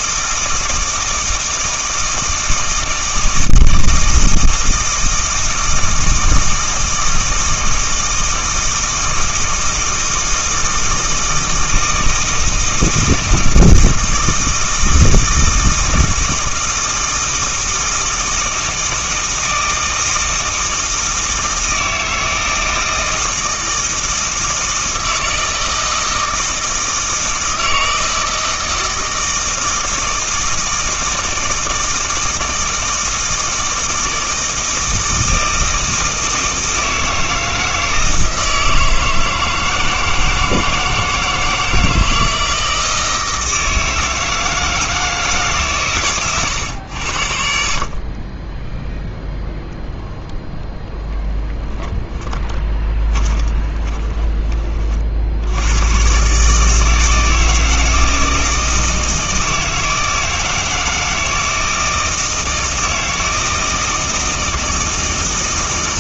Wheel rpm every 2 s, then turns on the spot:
160, 160, 160, 160, 160, 160, 160, 160, 160, 160, 160, 160, 160, 160, 160, 160, 160, 160, 160, 160, 160, 160, 160, 100, 0, 0, 20, 40, 160, 160, 160, 160, 160.
52-54